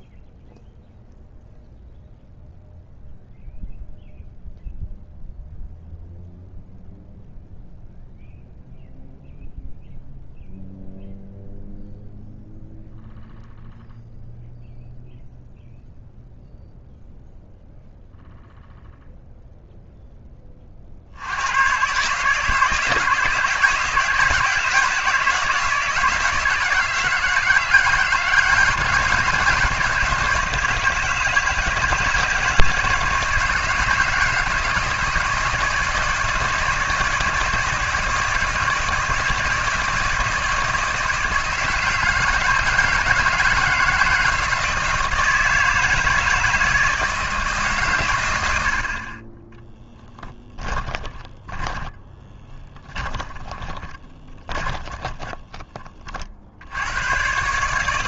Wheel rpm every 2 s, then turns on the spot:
0, 0, 0, 0, 0, 0, 0, 0, 0, 0, 40, 150, 170, 160, 170, 160, 160, 160, 160, 160, 160, 160, 160, 160, 60, 20, 20, 20, 80.
50-56